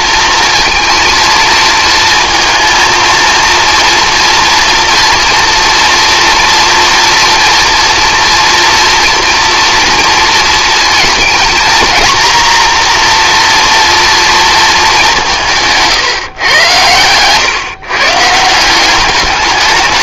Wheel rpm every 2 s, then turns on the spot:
230, 230, 230, 230, 230, 230, 240, 220, 120, 170.
none